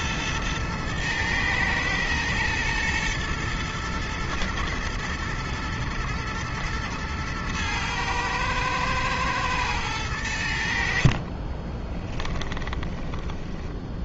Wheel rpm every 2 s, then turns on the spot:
110, 120, 110, 110, 110, 70, 20.
10-14